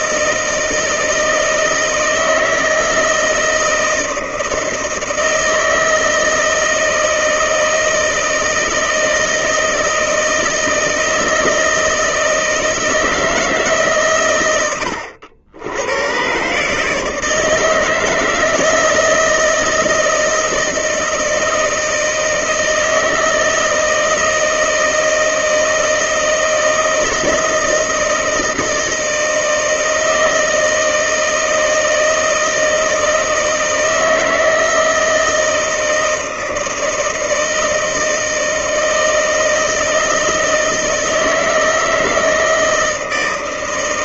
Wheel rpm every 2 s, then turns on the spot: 170, 160, 160, 160, 160, 160, 160, 100, 140, 160, 160, 160, 160, 160, 160, 160, 160, 160, 160, 160, 160, 160.
none